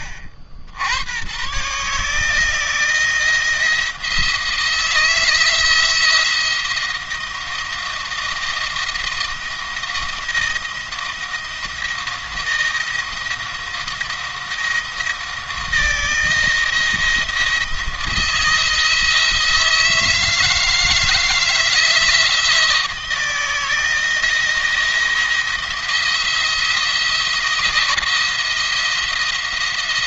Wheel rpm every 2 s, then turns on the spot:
70, 160, 160, 170, 170, 170, 170, 170, 170, 160, 160, 170, 170, 170, 170.
none